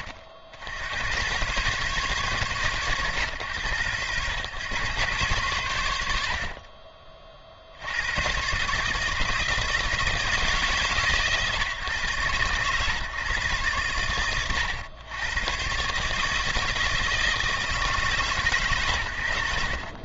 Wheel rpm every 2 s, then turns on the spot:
70, 140, 110, 40, 130, 150, 130, 110, 160, 110.
none